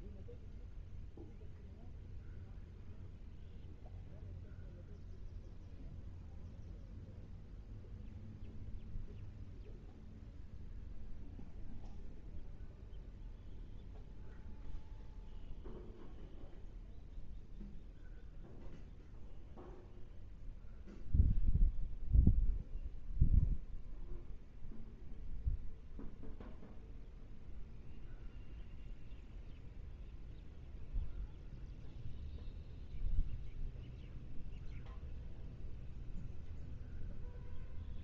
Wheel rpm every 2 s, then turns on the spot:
0, 0, 0, 0, 0, 0, 0, 0, 0, 0, 0, 0, 0, 0, 0, 0, 0, 0, 0.
none